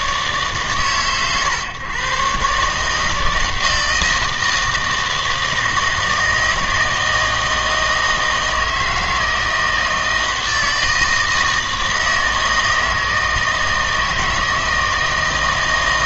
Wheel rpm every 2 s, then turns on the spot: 130, 140, 160, 160, 160, 160, 160, 160.
none